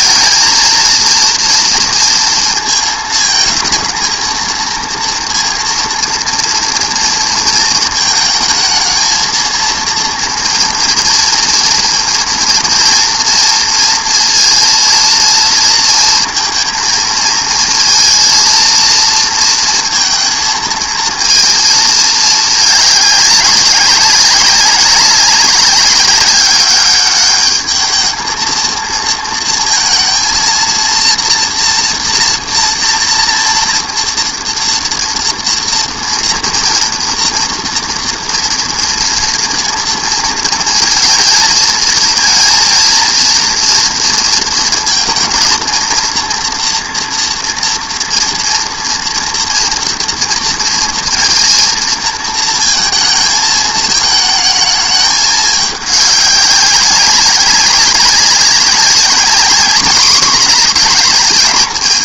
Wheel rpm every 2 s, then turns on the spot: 220, 220, 230, 230, 230, 240, 230, 230, 230, 230, 220, 210, 190, 200, 220, 230, 230, 240, 230, 230, 230, 230, 220, 230, 240, 230, 220, 220, 200, 190, 210.
none